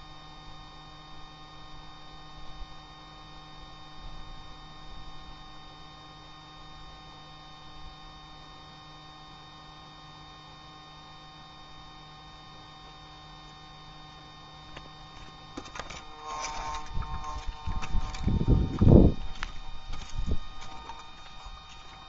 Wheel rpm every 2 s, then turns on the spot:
0, 0, 0, 0, 0, 0, 0, 0, 0, 0, 0.
none